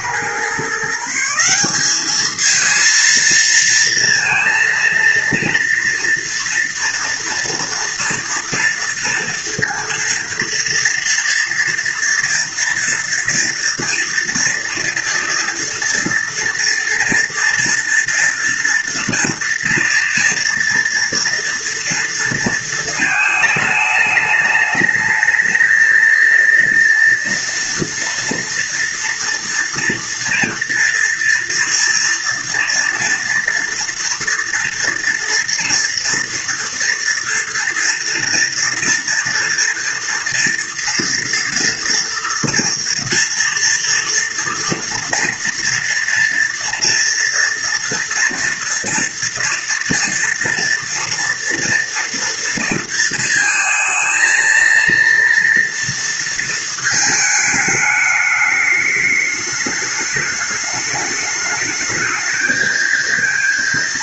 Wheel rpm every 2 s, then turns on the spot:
150, 220, 230, 230, 230, 230, 230, 230, 230, 230, 230, 220, 210, 230, 230, 240, 230, 230, 230, 230, 230, 230, 230, 230, 230, 230, 230, 230, 220, 210, 210, 220.
none